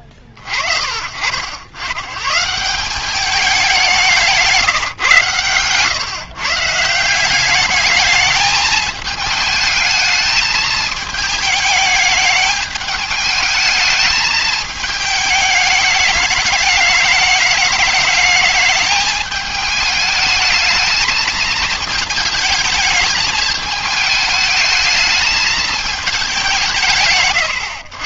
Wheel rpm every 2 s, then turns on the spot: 50, 160, 160, 150, 210, 220, 210, 220, 210, 210, 220, 220, 220, 190.
none